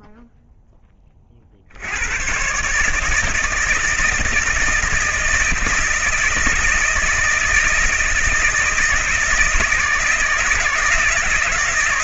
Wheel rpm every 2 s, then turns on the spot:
10, 140, 160, 160, 160, 160.
none